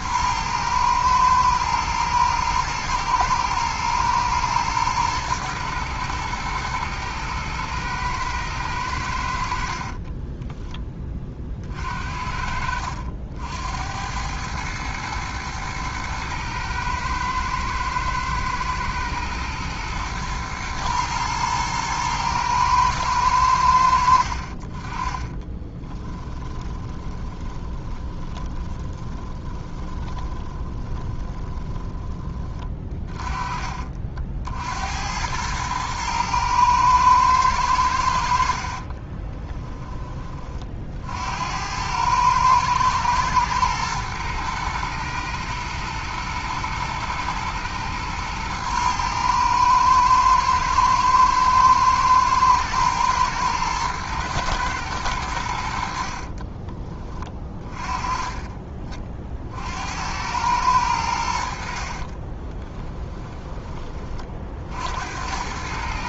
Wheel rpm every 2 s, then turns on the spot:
110, 110, 110, 120, 110, 20, 60, 110, 110, 110, 120, 110, 40, 10, 20, 20, 30, 70, 110, 50, 40, 110, 110, 120, 110, 110, 110, 110, 30, 30, 100, 20, 50.
10-14 24-32 38-40 56-58 62-64